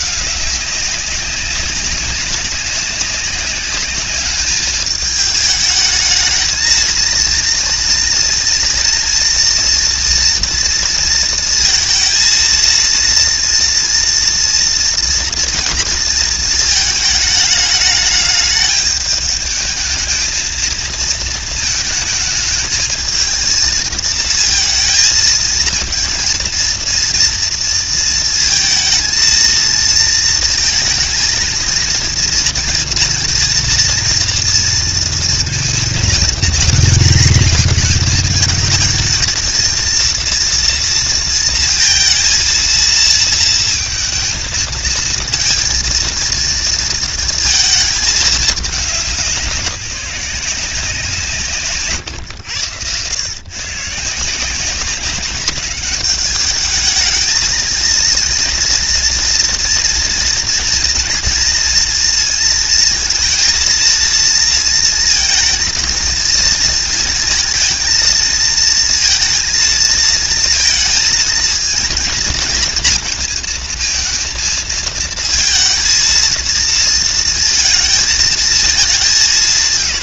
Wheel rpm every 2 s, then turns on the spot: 200, 190, 210, 220, 230, 230, 230, 230, 220, 220, 220, 220, 220, 230, 230, 230, 230, 230, 230, 220, 230, 220, 220, 230, 200, 180, 100, 190, 220, 230, 230, 220, 230, 230, 230, 230, 230, 230, 230, 200.
none